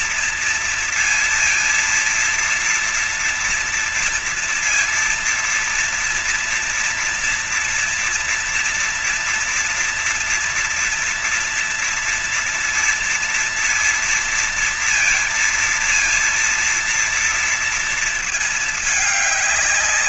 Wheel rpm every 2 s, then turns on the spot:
230, 230, 230, 230, 230, 230, 230, 230, 230, 220.
none